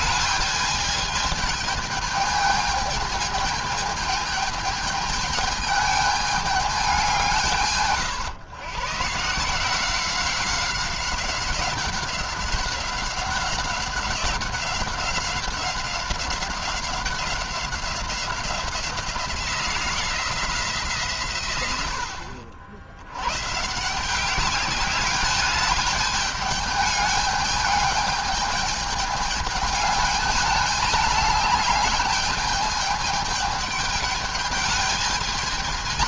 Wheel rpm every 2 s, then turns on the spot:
210, 210, 220, 200, 120, 190, 190, 190, 190, 180, 170, 70, 200, 210, 210, 210, 210, 210.
none